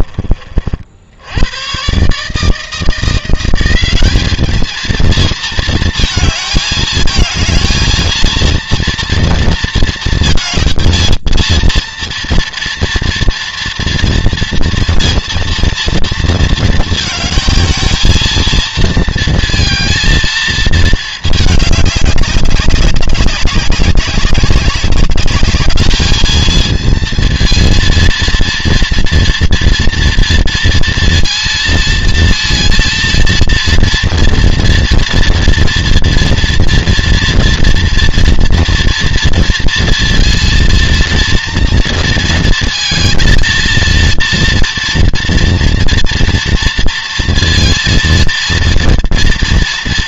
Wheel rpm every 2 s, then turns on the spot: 30, 150, 210, 220, 230, 220, 230, 230, 230, 230, 220, 200, 200, 230, 230, 230, 230, 230, 230, 230, 230, 230, 240, 230, 230.
none